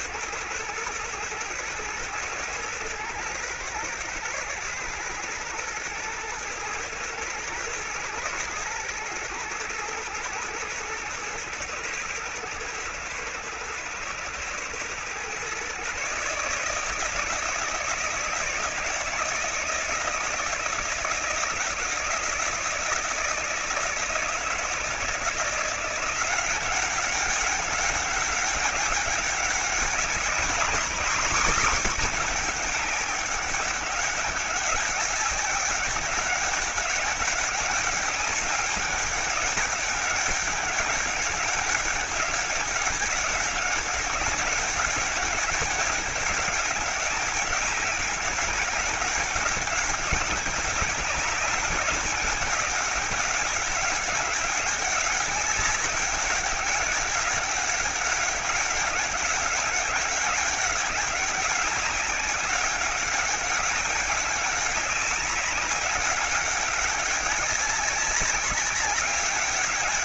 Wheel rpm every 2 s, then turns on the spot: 110, 110, 110, 120, 110, 110, 110, 120, 150, 160, 160, 160, 160, 190, 200, 220, 190, 200, 200, 200, 200, 200, 200, 190, 190, 200, 200, 200, 200, 200, 200, 200, 200, 200, 200.
none